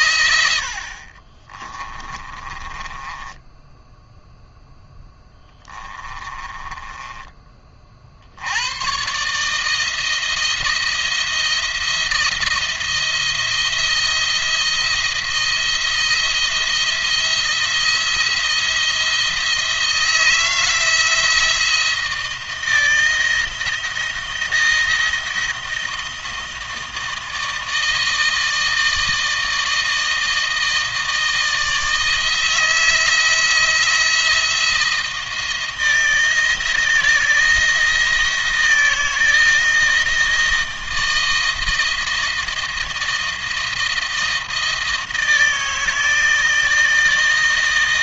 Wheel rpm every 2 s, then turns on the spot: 80, 30, 0, 20, 90, 170, 170, 170, 170, 170, 160, 170, 170, 160, 160, 160, 160, 160, 170, 170, 160, 170, 160, 160.
2-4 6-8